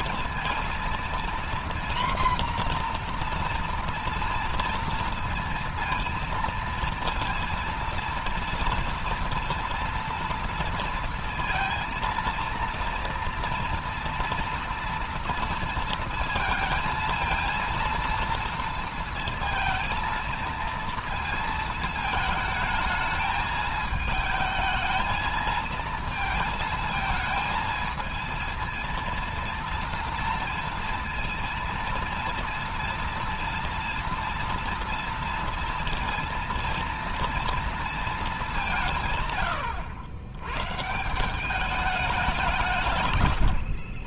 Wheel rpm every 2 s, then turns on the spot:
230, 240, 230, 230, 230, 230, 230, 230, 230, 230, 230, 220, 220, 220, 230, 230, 230, 230, 230, 170, 130, 160.
none